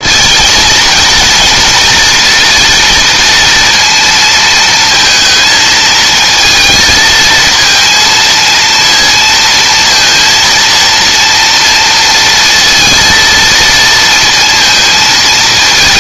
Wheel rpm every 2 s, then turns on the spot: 230, 230, 230, 220, 230, 230, 230, 220.
none